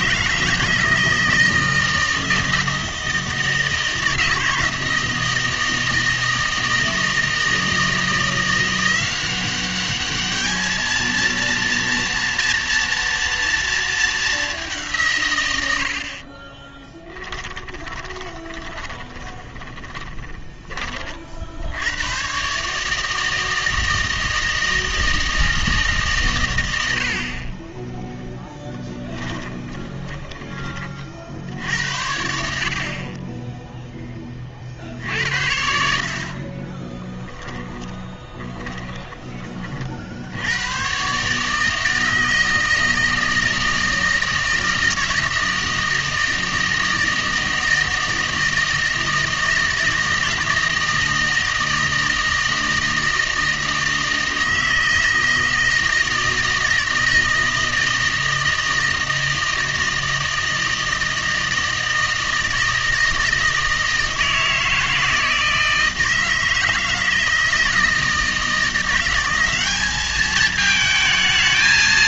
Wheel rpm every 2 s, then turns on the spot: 160, 160, 160, 160, 170, 220, 230, 180, 20, 20, 20, 140, 160, 90, 10, 20, 60, 50, 20, 20, 100, 160, 160, 160, 160, 160, 160, 160, 160, 160, 160, 160, 160, 160, 170, 220.
16-20 28-30 36-40